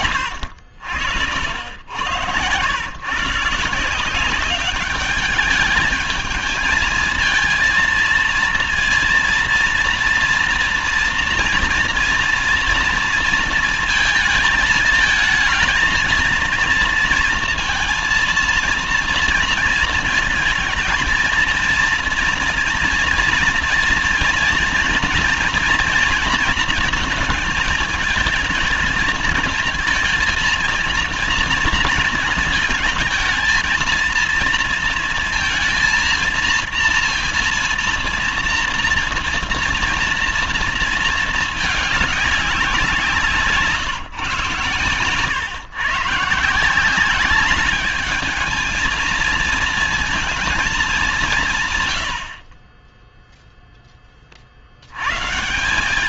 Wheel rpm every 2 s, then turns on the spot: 80, 130, 200, 220, 230, 230, 230, 220, 230, 230, 230, 230, 230, 220, 220, 230, 220, 230, 230, 230, 230, 180, 130, 170, 220, 210, 20, 90.
none